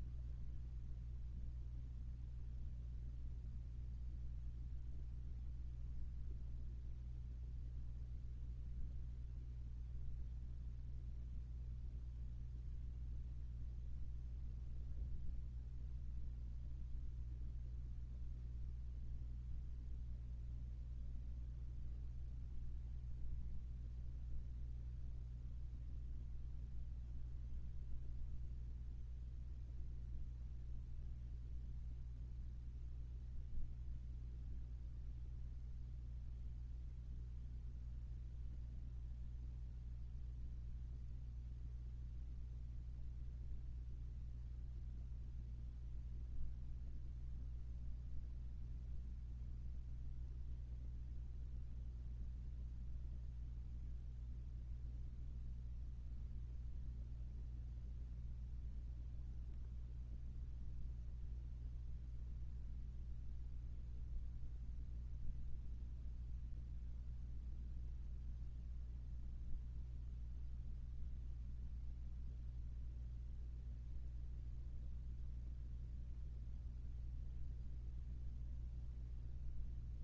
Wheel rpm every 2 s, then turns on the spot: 0, 0, 0, 0, 0, 0, 0, 0, 0, 0, 0, 0, 0, 0, 0, 0, 0, 0, 0, 0, 0, 0, 0, 0, 0, 0, 0, 0, 0, 0, 0, 0, 0, 0, 0, 0, 0, 0, 0, 0.
none